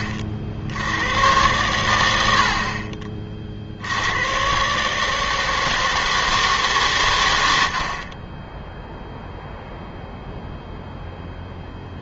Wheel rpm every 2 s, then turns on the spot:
90, 40, 140, 140, 0, 0.
none